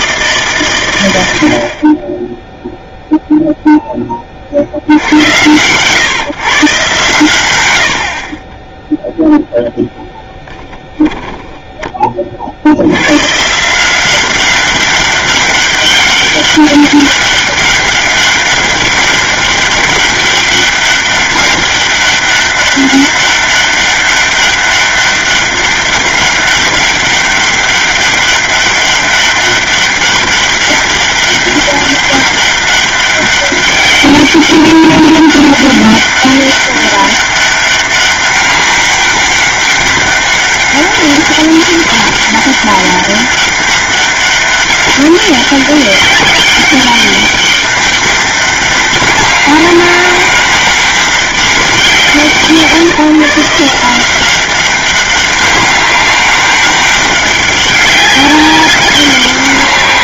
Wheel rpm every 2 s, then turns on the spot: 140, 0, 60, 130, 10, 0, 60, 190, 200, 200, 200, 200, 200, 200, 190, 200, 200, 200, 200, 200, 200, 200, 200, 200, 200, 200, 170, 190, 200, 190.
none